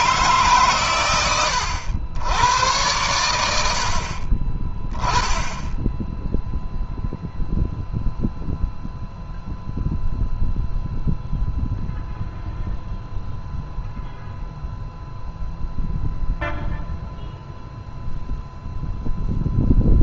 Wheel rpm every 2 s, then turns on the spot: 120, 100, 10, 0, 0, 0, 0, 0, 0, 0.
none